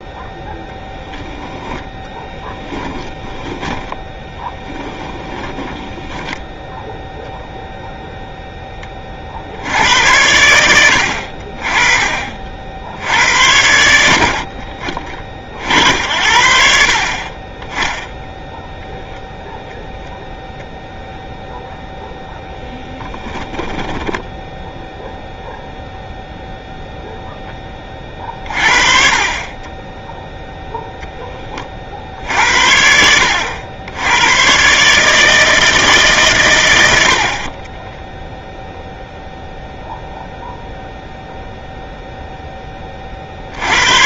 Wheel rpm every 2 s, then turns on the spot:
0, 10, 10, 0, 20, 90, 70, 40, 50, 0, 0, 10, 0, 0, 40, 0, 70, 140, 100, 0, 0, 10.
2-6 22-24